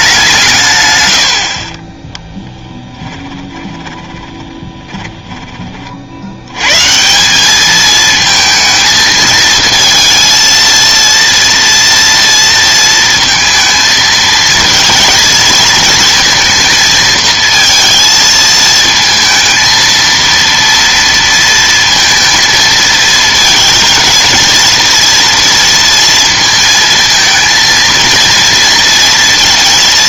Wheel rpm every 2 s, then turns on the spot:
150, 10, 20, 110, 230, 230, 230, 230, 230, 220, 230, 230, 230, 230, 230.
2-6